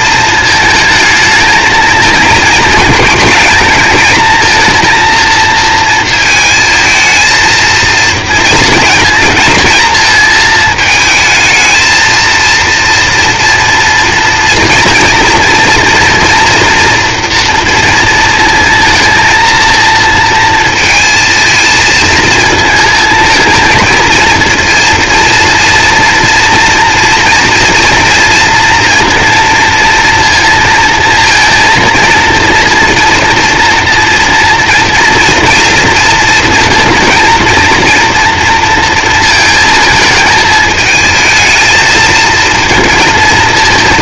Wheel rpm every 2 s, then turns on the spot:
220, 220, 230, 220, 230, 220, 230, 230, 230, 230, 230, 220, 230, 230, 240, 230, 230, 230, 230, 230, 220, 230.
none